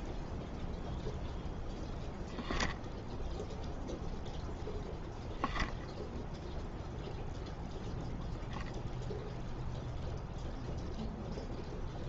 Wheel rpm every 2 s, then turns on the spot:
0, 0, 0, 0, 0, 0.
none